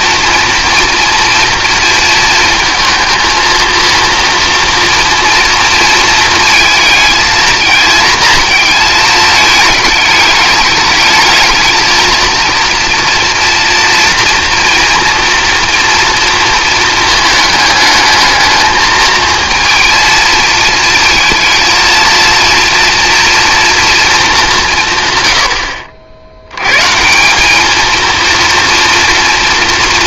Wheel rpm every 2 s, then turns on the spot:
230, 220, 230, 230, 220, 210, 230, 230, 220, 220, 230, 230, 160, 130, 230.
none